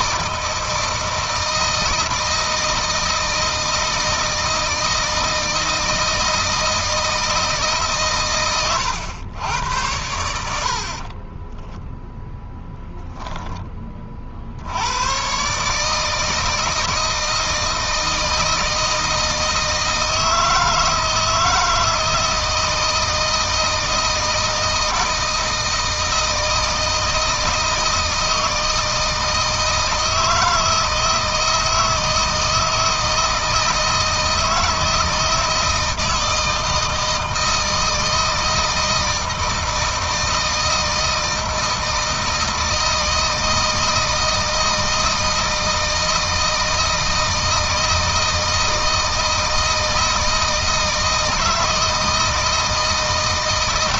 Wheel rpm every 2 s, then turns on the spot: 160, 160, 160, 160, 120, 50, 10, 80, 160, 160, 160, 160, 160, 160, 160, 160, 160, 160, 160, 160, 160, 160, 160, 160, 160, 160, 160.
10-14